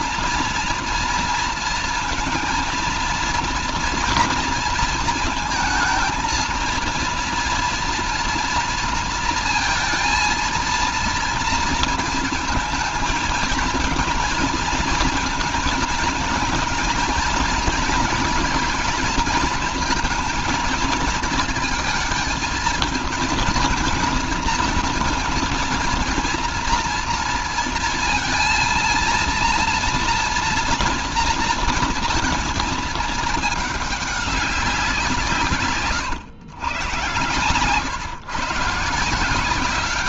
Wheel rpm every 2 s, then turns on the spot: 230, 230, 230, 230, 230, 230, 220, 230, 230, 230, 230, 220, 230, 230, 230, 230, 230, 190, 120, 150.
none